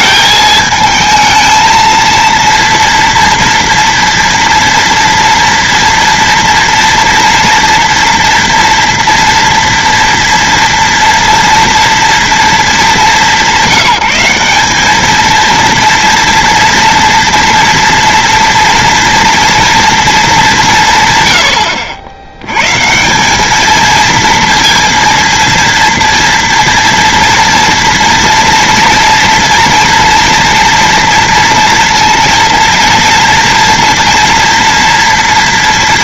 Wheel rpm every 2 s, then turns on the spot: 220, 230, 230, 230, 230, 230, 210, 200, 230, 230, 190, 130, 230, 230, 230, 240, 230, 230.
none